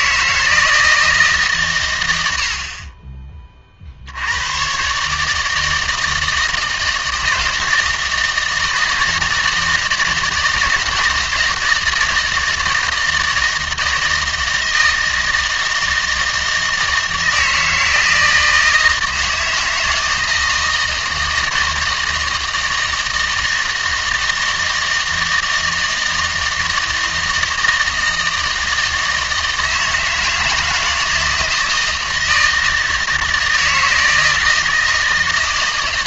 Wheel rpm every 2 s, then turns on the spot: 160, 50, 120, 160, 160, 160, 160, 160, 160, 160, 160, 160, 160, 160, 160, 160, 160, 160.
none